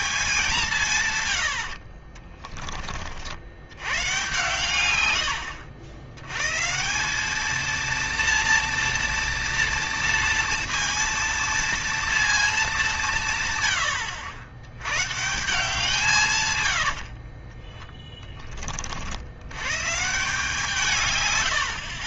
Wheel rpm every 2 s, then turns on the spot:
190, 30, 120, 120, 230, 230, 210, 100, 130, 30, 140.
2-4